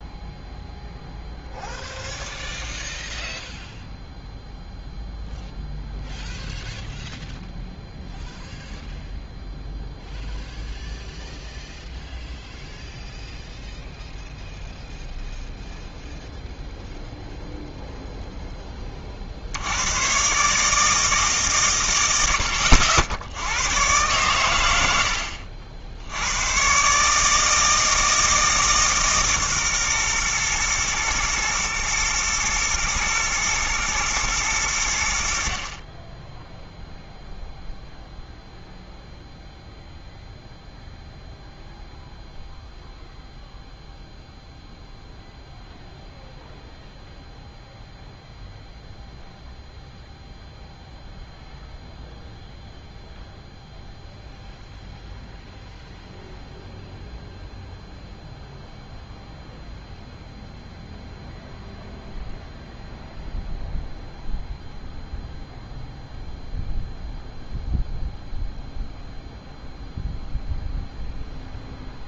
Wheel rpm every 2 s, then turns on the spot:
0, 0, 0, 0, 0, 0, 0, 0, 0, 30, 150, 80, 100, 130, 150, 120, 110, 90, 0, 0, 0, 0, 0, 0, 0, 0, 0, 0, 0, 0, 0, 0, 0, 0, 0, 0.
none